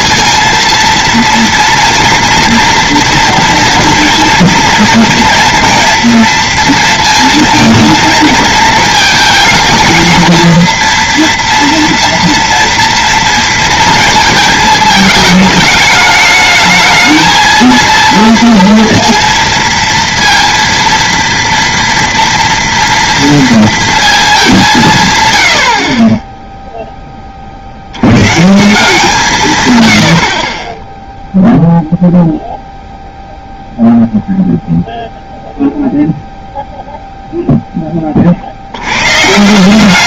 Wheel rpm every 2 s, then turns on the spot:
230, 230, 230, 230, 220, 230, 230, 220, 220, 230, 230, 230, 200, 0, 150, 30, 0, 0, 0, 70.
none